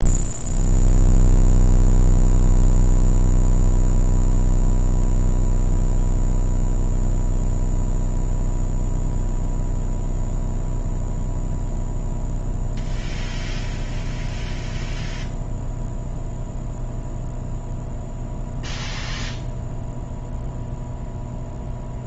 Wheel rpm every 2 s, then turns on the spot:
0, 0, 0, 0, 0, 0, 0, 0, 0, 0, 0.
none